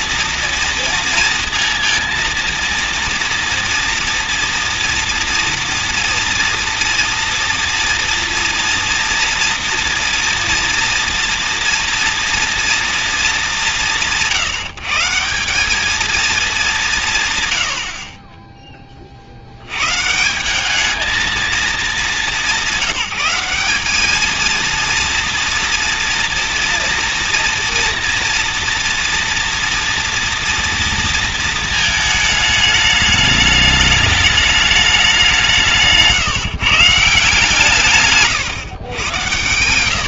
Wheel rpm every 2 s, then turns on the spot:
230, 230, 230, 230, 230, 230, 230, 160, 210, 30, 210, 190, 230, 230, 230, 230, 220, 220, 150, 120.
none